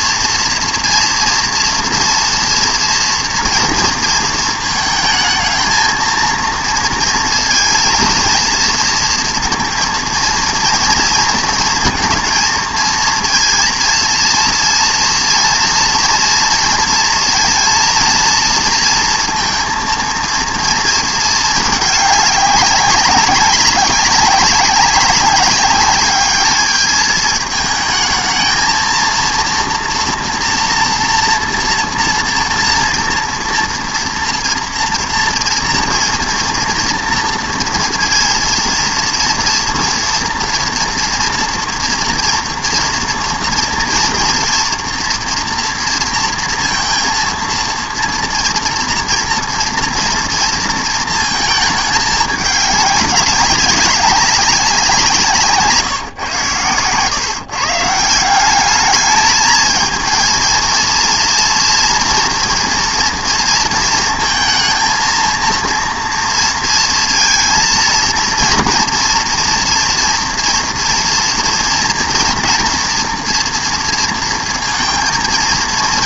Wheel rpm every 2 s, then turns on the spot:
230, 240, 220, 230, 230, 230, 230, 230, 230, 230, 230, 210, 200, 210, 230, 230, 230, 230, 230, 230, 230, 230, 230, 230, 230, 230, 210, 190, 130, 200, 230, 230, 230, 230, 230, 230, 230, 230.
none